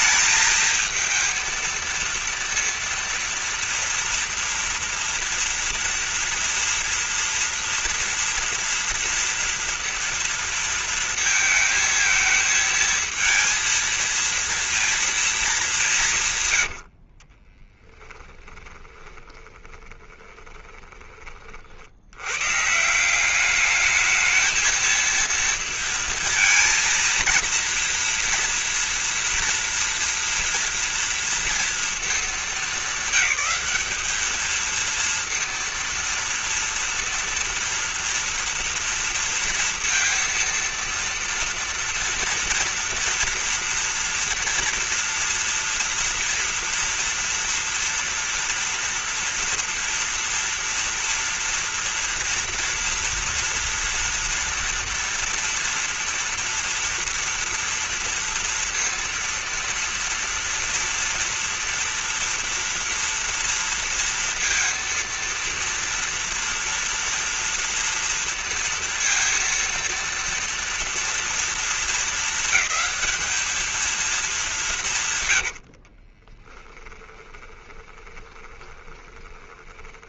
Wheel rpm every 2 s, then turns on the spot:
220, 230, 230, 230, 230, 230, 220, 230, 150, 20, 20, 100, 220, 230, 230, 230, 220, 220, 230, 230, 230, 230, 230, 230, 230, 230, 230, 230, 230, 230, 230, 230, 230, 230, 230, 230, 220, 200, 30, 20.
18-22 76-80